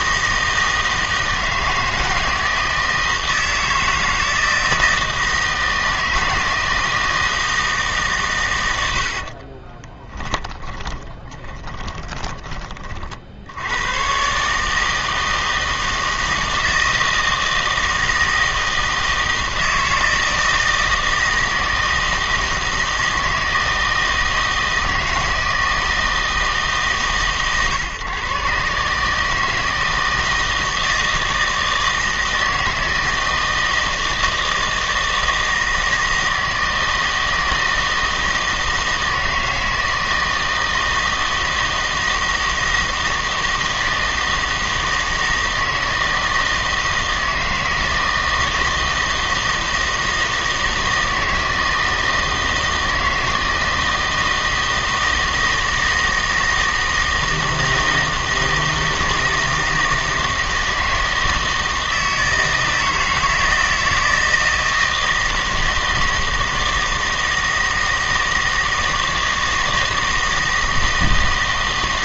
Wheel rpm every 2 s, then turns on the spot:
160, 160, 160, 160, 100, 20, 40, 150, 160, 160, 160, 160, 160, 150, 140, 160, 160, 160, 160, 160, 160, 160, 160, 160, 160, 160, 160, 160, 160, 160, 160, 160, 160, 160, 160, 160.
10-12